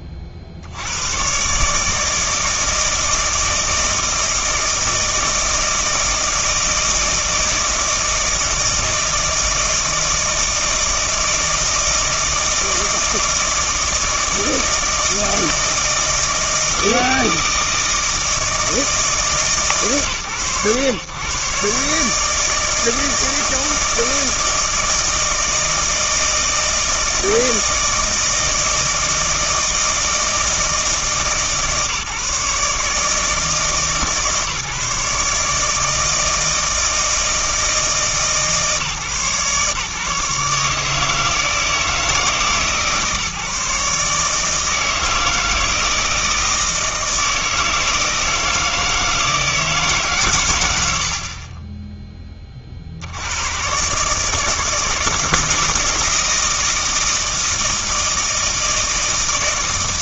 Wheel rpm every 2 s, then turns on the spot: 50, 160, 160, 160, 160, 160, 160, 160, 160, 160, 110, 160, 160, 160, 160, 160, 150, 150, 160, 150, 150, 150, 160, 160, 160, 100, 60, 160, 160, 160.
none